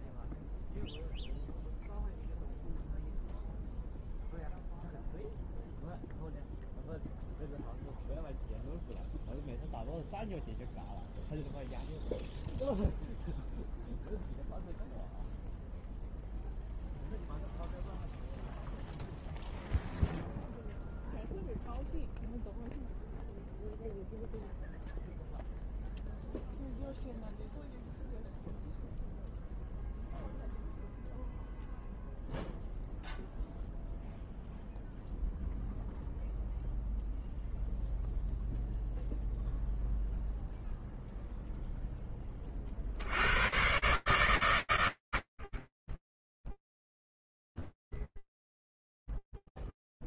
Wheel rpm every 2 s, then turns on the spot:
0, 0, 0, 0, 0, 0, 0, 0, 0, 0, 0, 0, 0, 0, 0, 0, 0, 0, 0, 0, 0, 30, 140, 20, 0.
none